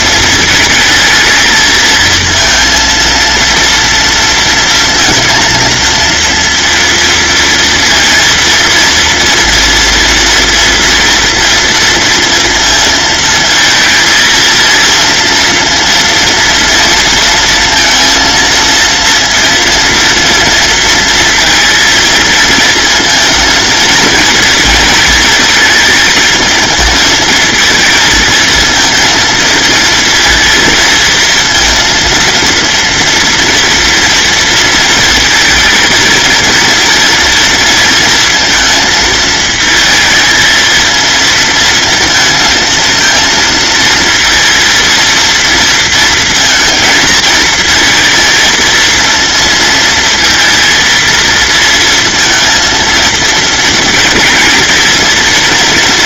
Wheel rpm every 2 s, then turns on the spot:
220, 230, 230, 230, 230, 230, 230, 230, 230, 230, 230, 230, 220, 230, 230, 230, 230, 230, 230, 220, 230, 230, 230, 220, 230, 230, 230, 230.
none